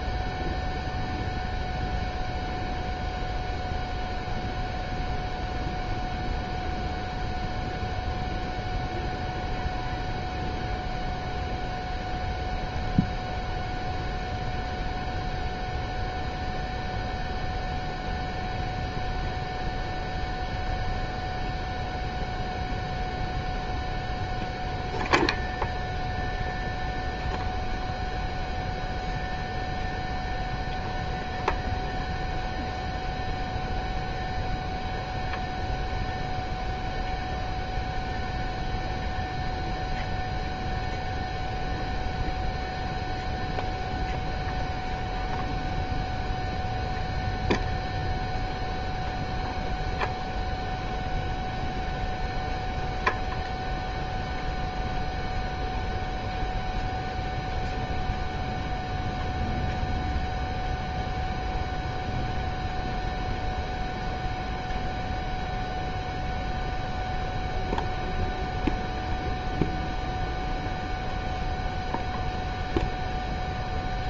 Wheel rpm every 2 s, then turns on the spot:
0, 0, 0, 0, 0, 0, 0, 0, 0, 0, 0, 0, 0, 0, 0, 0, 0, 0, 0, 0, 0, 0, 0, 0, 0, 0, 0, 0, 0, 0, 0, 0, 0, 0, 0, 0, 0.
none